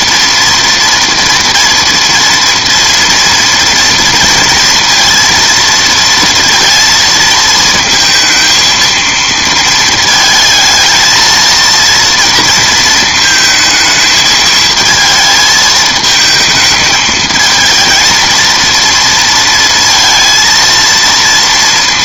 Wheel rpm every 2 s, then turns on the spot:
230, 230, 230, 230, 230, 220, 230, 220, 220, 230, 230.
none